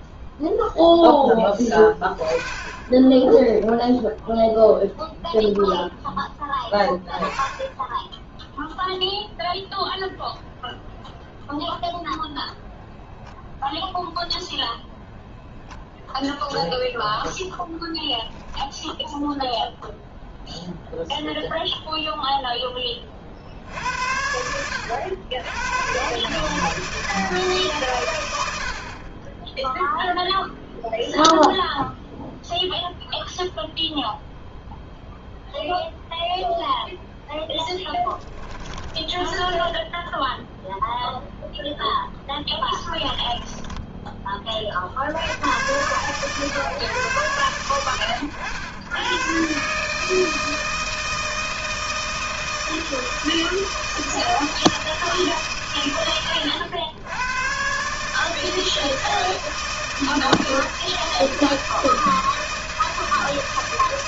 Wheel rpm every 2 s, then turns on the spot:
10, 0, 0, 10, 0, 0, 0, 0, 0, 0, 10, 80, 150, 70, 0, 0, 0, 0, 20, 0, 10, 30, 130, 90, 160, 160, 160, 100, 150, 160, 160, 160.
36-38 40-42